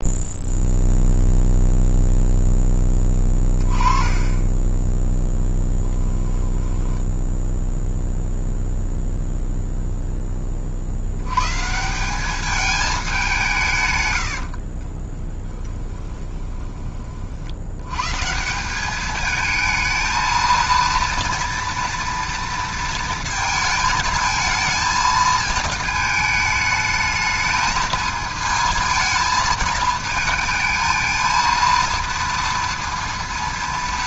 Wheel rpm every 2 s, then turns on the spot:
0, 10, 10, 10, 0, 40, 210, 50, 20, 180, 230, 230, 220, 220, 220, 220, 230.
14-16